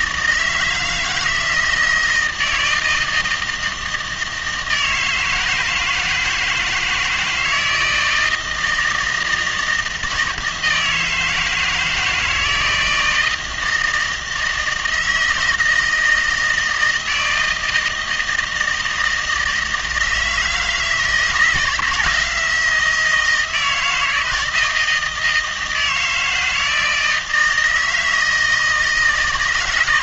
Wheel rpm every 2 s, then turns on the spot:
160, 160, 160, 160, 160, 160, 160, 160, 160, 160, 160, 170, 160, 160, 160.
none